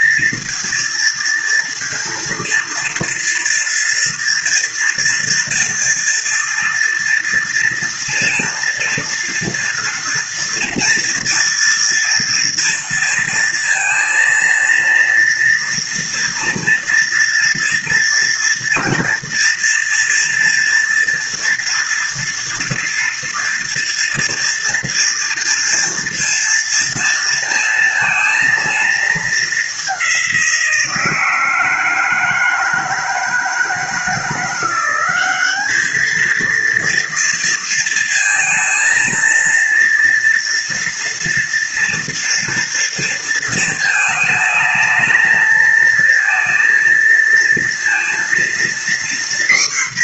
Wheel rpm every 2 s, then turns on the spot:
230, 230, 230, 230, 230, 230, 230, 230, 230, 230, 230, 230, 230, 230, 230, 180, 160, 170, 220, 230, 230, 230, 220, 230, 230.
none